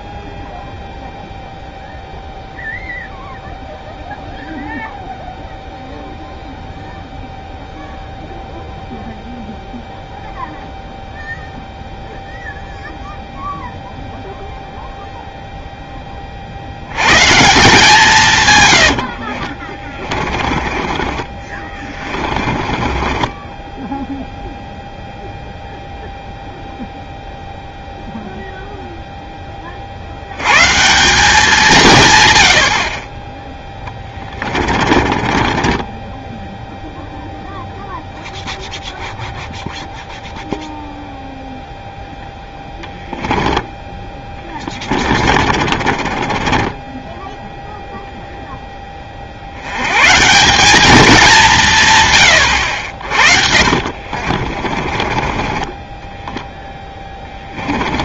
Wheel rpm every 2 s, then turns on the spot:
0, 0, 0, 0, 0, 0, 0, 0, 80, 120, 20, 30, 0, 0, 0, 140, 60, 30, 0, 0, 0, 10, 30, 20, 10, 200, 80, 30, 10.
18-24 34-36 44-48 54-58